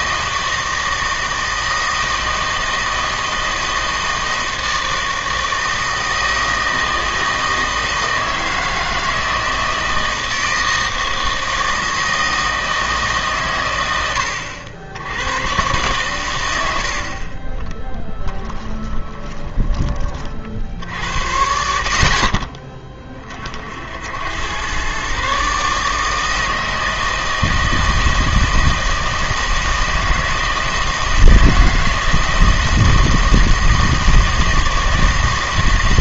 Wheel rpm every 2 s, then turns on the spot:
160, 160, 160, 160, 160, 160, 160, 80, 80, 20, 50, 30, 120, 160, 160, 160, 160, 160.
18-20